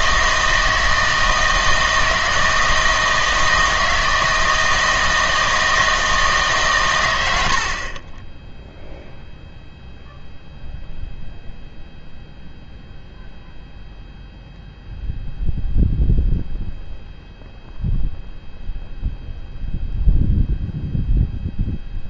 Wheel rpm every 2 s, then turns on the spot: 160, 160, 160, 130, 0, 0, 0, 0, 0, 0, 0.
none